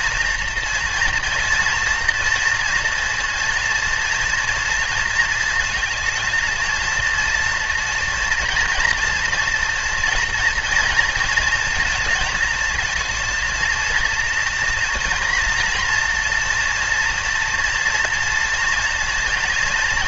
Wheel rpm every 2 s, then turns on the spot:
230, 230, 230, 230, 230, 230, 220, 230, 230, 230.
none